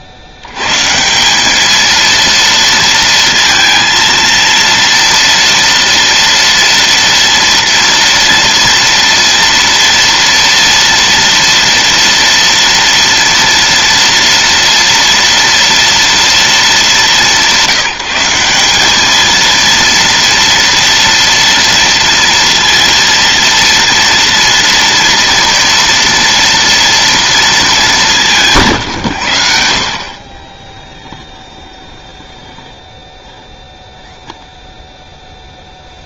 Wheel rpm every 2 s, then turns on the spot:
20, 220, 230, 230, 230, 230, 230, 230, 230, 180, 230, 230, 230, 230, 210, 60, 0, 0.
none